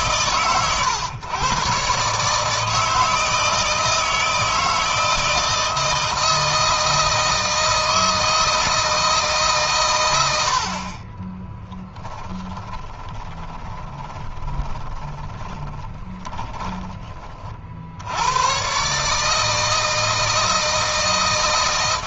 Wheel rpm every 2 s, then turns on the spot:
120, 160, 160, 160, 160, 50, 20, 20, 30, 130, 160.
12-16